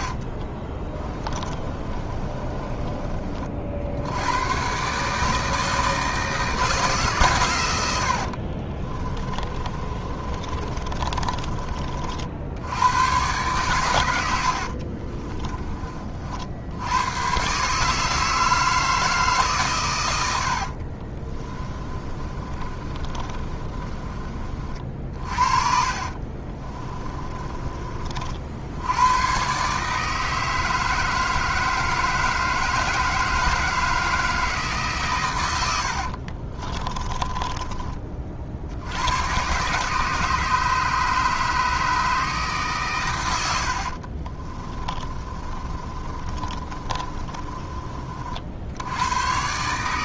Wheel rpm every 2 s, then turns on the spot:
30, 30, 130, 150, 40, 30, 90, 50, 90, 160, 50, 30, 40, 30, 90, 160, 160, 140, 20, 80, 150, 130, 20, 30, 80.
0-2 8-12 14-16 20-24 26-28 36-38 44-48